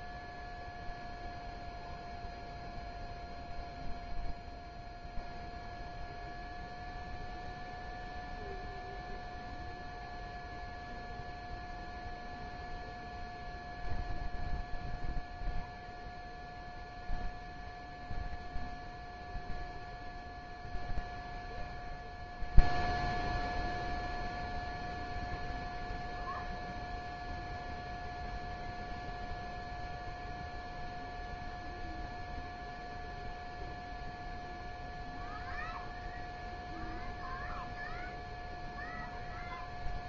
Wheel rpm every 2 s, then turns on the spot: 0, 0, 0, 0, 0, 0, 0, 0, 0, 0, 0, 0, 0, 0, 0, 0, 0, 0, 0, 0.
none